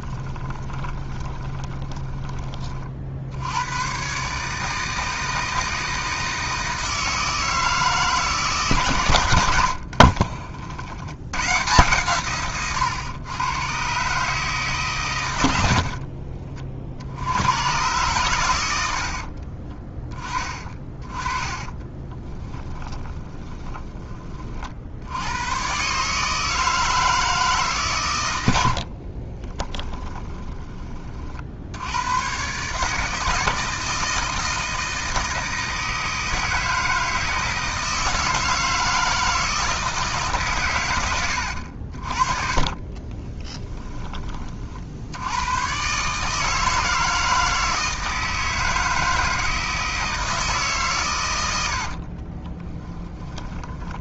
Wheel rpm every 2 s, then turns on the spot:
20, 40, 160, 160, 140, 80, 120, 140, 50, 80, 20, 20, 70, 160, 50, 30, 140, 160, 160, 170, 120, 30, 60, 160, 160, 140, 20.
0-2 22-24 28-30 42-44 52-54